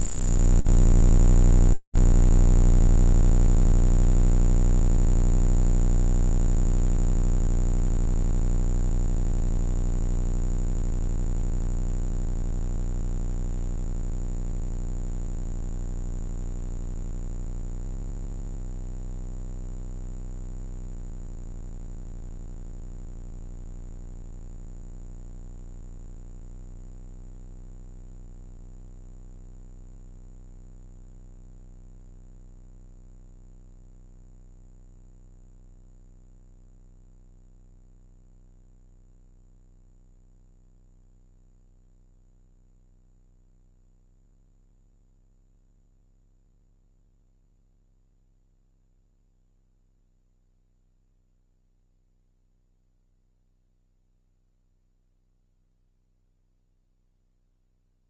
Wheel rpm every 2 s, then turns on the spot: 0, 0, 0, 0, 0, 0, 0, 0, 0, 0, 0, 0, 0, 0, 0, 0, 0, 0, 0, 0, 0, 0, 0, 0, 0, 0, 0, 0, 0.
none